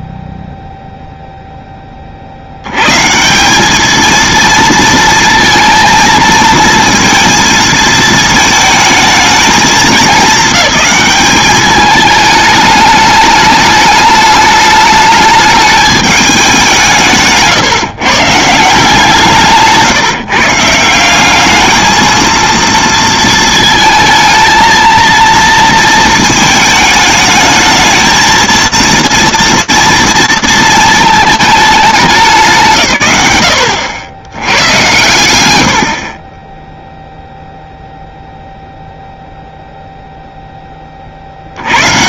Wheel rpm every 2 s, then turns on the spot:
0, 90, 230, 230, 220, 210, 210, 210, 200, 160, 170, 230, 230, 220, 230, 220, 130, 110, 0, 0, 20.
none